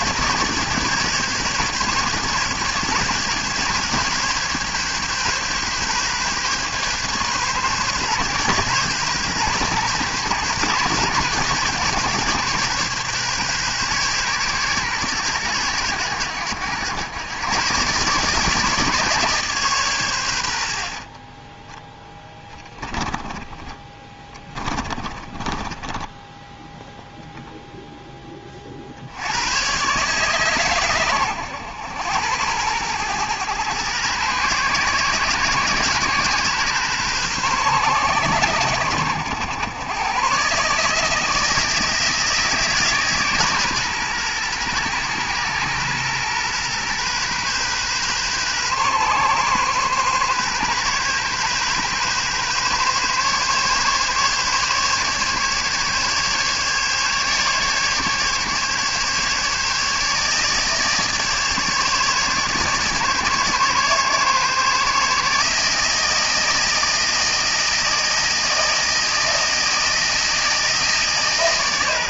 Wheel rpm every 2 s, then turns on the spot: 140, 140, 140, 140, 130, 130, 130, 120, 100, 150, 60, 20, 20, 0, 50, 120, 110, 120, 130, 100, 150, 150, 120, 130, 130, 130, 140, 140, 140, 140, 150, 150, 150, 160, 160, 160.
20-26